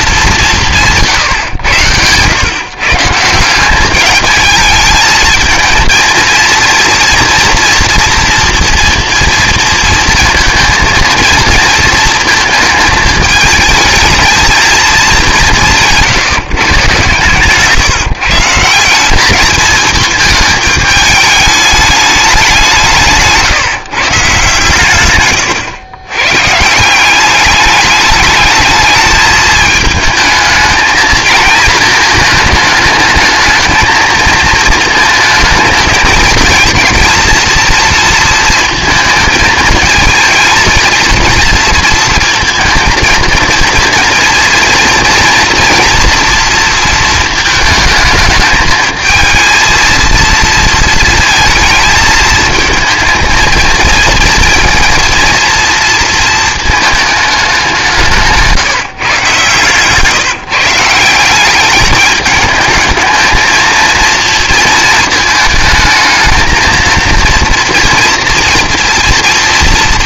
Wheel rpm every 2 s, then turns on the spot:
170, 130, 220, 230, 230, 230, 220, 220, 140, 180, 210, 180, 130, 170, 220, 220, 220, 220, 220, 230, 220, 230, 230, 230, 220, 230, 230, 230, 220, 160, 160, 210, 230, 230, 230.
none